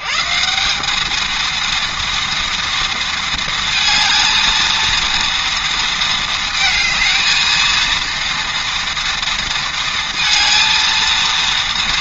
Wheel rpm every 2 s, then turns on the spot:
90, 230, 230, 220, 230, 230.
none